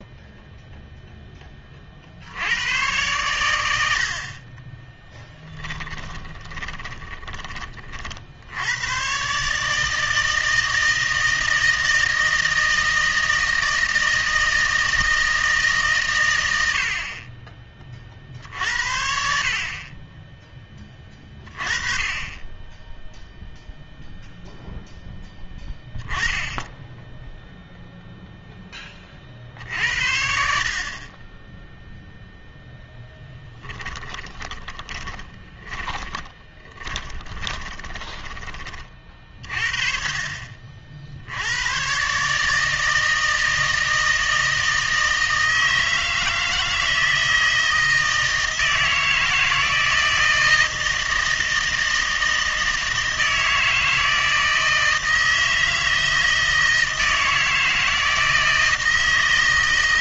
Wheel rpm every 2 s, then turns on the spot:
0, 100, 10, 20, 90, 160, 160, 160, 80, 50, 20, 10, 0, 10, 10, 50, 0, 20, 30, 40, 50, 160, 160, 160, 160, 160, 160, 160, 160, 160.
4-8 34-38